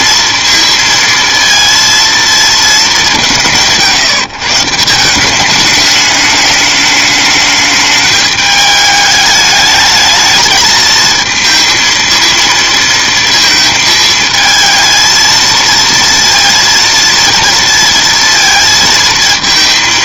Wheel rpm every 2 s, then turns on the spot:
230, 210, 150, 210, 210, 220, 230, 220, 230, 230.
none